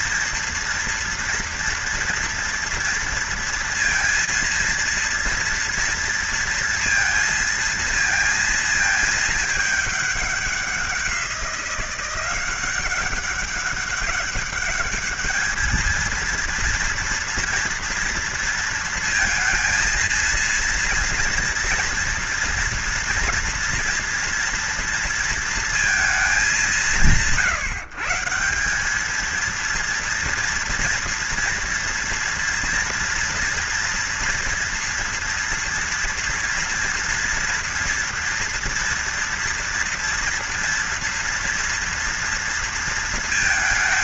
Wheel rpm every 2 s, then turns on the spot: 230, 230, 230, 230, 220, 190, 190, 210, 230, 230, 240, 240, 230, 180, 200, 230, 230, 240, 240, 230, 230, 230.
none